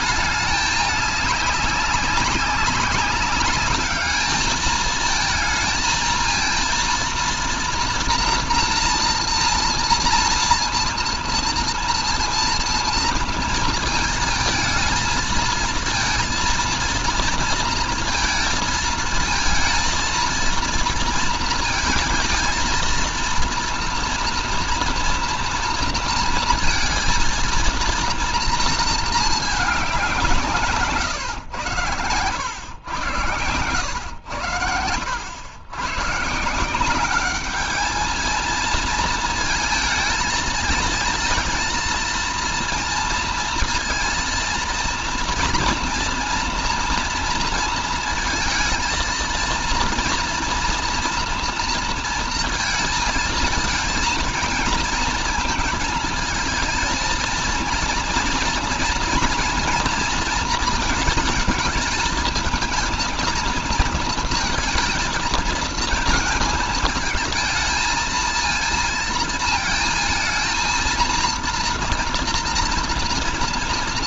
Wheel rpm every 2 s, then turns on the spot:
210, 200, 220, 230, 240, 230, 230, 220, 230, 220, 230, 230, 230, 230, 230, 150, 100, 100, 170, 230, 230, 230, 230, 230, 230, 230, 230, 230, 220, 230, 220, 220, 230, 220, 230, 230, 230.
none